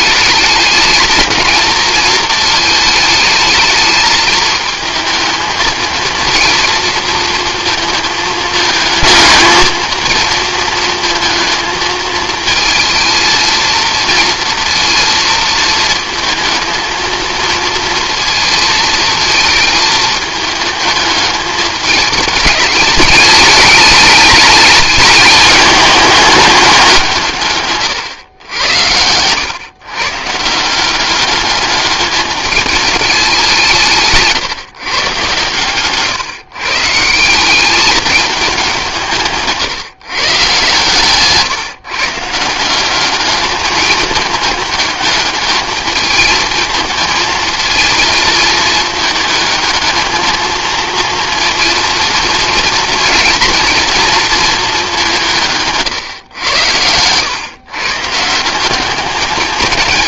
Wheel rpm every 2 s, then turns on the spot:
210, 220, 220, 230, 220, 230, 220, 230, 220, 220, 220, 210, 210, 190, 90, 170, 210, 150, 150, 190, 140, 180, 210, 220, 220, 220, 230, 210, 100, 180.
none